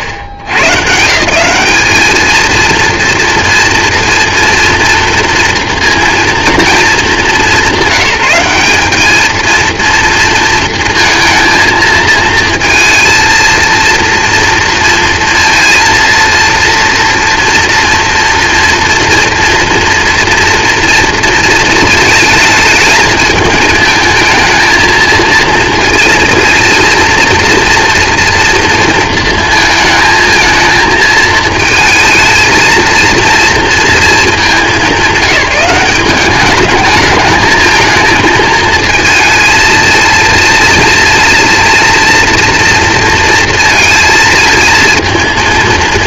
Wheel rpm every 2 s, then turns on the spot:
110, 230, 230, 220, 200, 230, 230, 230, 230, 230, 230, 220, 220, 230, 230, 220, 230, 200, 200, 220, 230, 230, 220.
none